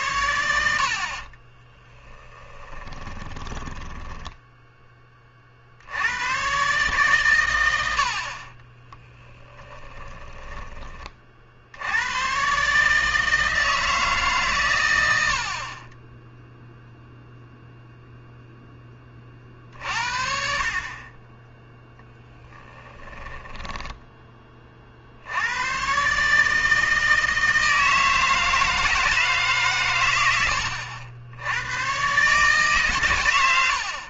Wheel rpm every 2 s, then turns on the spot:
70, 20, 10, 130, 30, 20, 140, 110, 0, 10, 50, 10, 40, 160, 160, 90, 140.
2-4 8-10 22-24